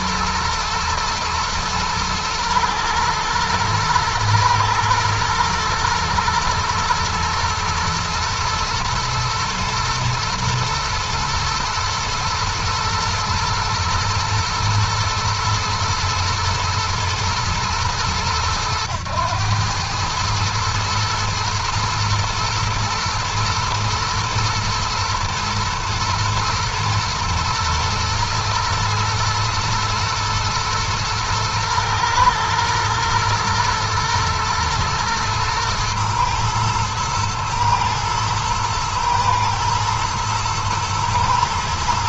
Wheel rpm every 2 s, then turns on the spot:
110, 110, 120, 110, 120, 120, 110, 110, 110, 100, 110, 120, 110, 110, 110, 110, 120, 120, 110, 110, 110.
none